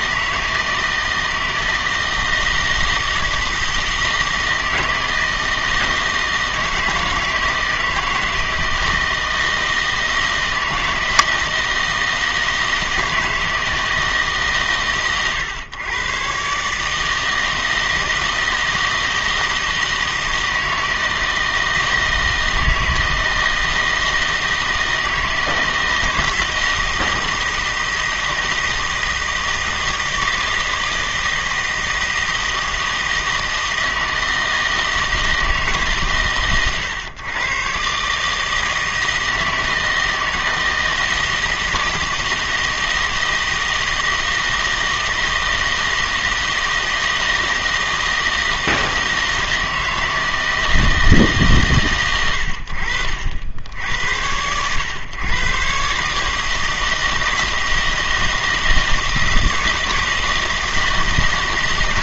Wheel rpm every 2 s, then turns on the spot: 160, 160, 160, 160, 160, 160, 160, 130, 140, 160, 160, 160, 160, 160, 160, 160, 160, 160, 120, 160, 160, 160, 160, 160, 160, 160, 70, 110, 160, 160, 160.
none